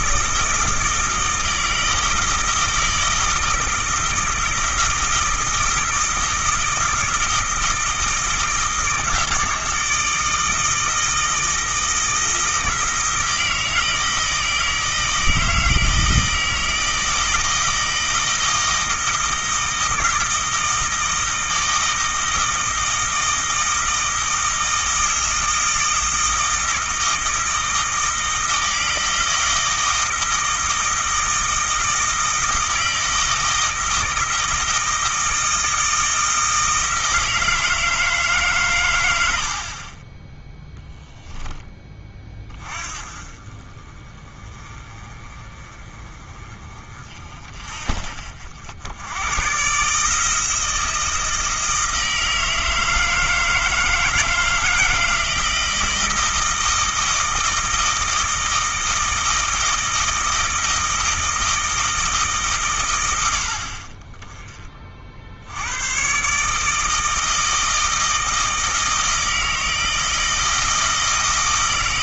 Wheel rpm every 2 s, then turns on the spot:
160, 160, 160, 160, 160, 160, 160, 160, 160, 160, 160, 160, 160, 160, 160, 160, 160, 160, 160, 100, 0, 30, 30, 40, 90, 160, 160, 160, 160, 160, 160, 110, 50, 160, 160, 160.
none